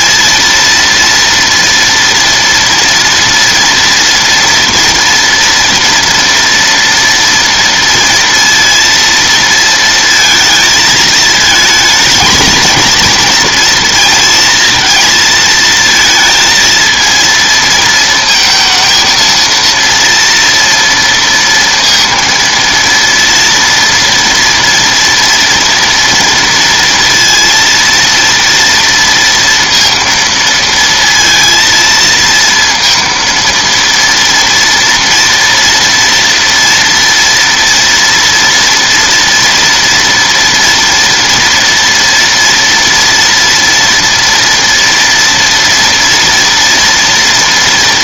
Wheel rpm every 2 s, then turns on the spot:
230, 230, 230, 230, 230, 220, 220, 230, 220, 230, 230, 230, 230, 230, 230, 230, 230, 230, 230, 230, 230, 230, 230, 230.
none